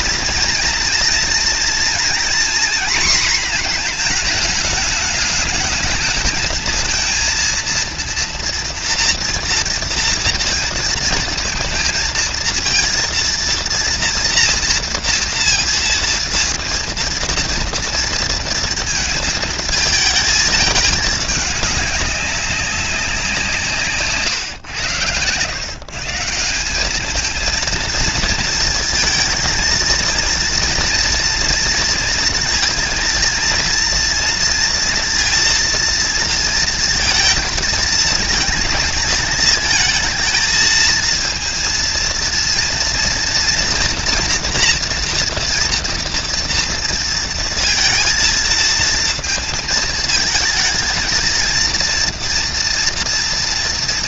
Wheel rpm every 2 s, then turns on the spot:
230, 240, 210, 230, 230, 230, 230, 230, 230, 230, 210, 190, 110, 210, 220, 230, 230, 230, 230, 230, 230, 230, 240, 230, 220, 220, 230.
none